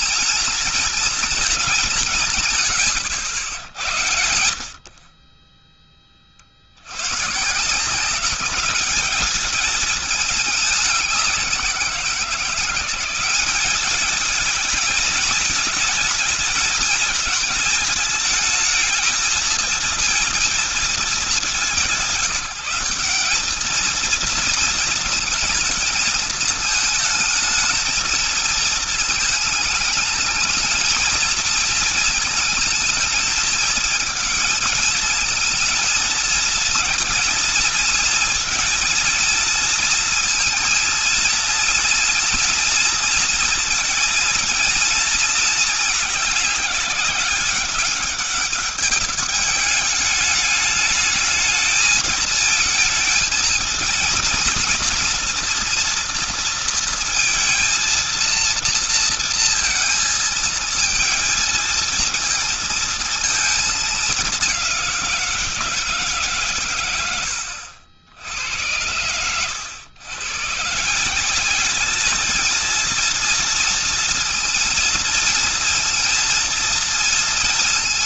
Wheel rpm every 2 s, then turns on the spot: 230, 110, 50, 80, 200, 200, 180, 220, 220, 220, 220, 190, 220, 220, 220, 230, 220, 220, 230, 230, 230, 230, 230, 190, 210, 210, 220, 230, 230, 230, 220, 230, 190, 120, 90, 150, 220, 230, 230.
none